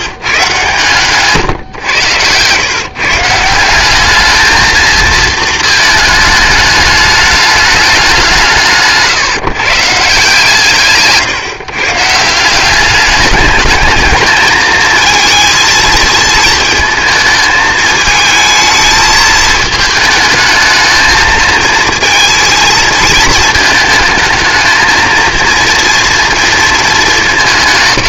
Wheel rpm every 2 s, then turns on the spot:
130, 120, 220, 210, 160, 160, 180, 220, 220, 220, 220, 220, 220, 220.
none